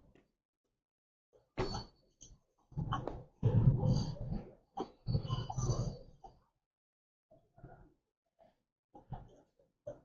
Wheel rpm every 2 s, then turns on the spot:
0, 0, 0, 0, 0.
none